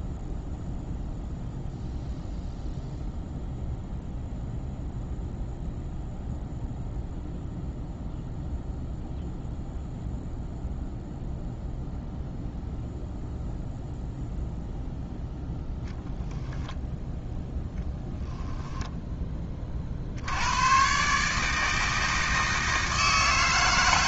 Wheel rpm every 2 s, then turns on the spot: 0, 0, 0, 0, 0, 0, 0, 0, 0, 0, 120, 160.
none